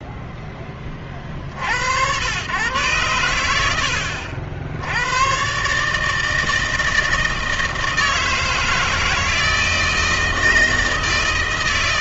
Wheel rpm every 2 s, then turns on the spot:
20, 110, 80, 160, 160, 160.
none